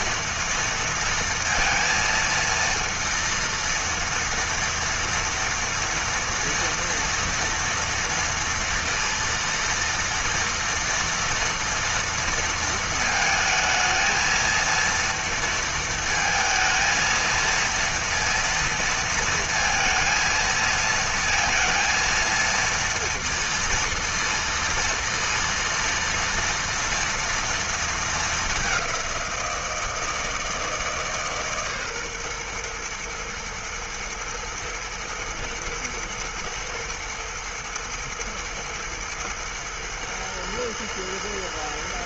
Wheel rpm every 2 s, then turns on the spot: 230, 230, 230, 230, 230, 230, 220, 230, 230, 230, 230, 230, 230, 240, 190, 160, 120, 120, 110, 110, 110.
none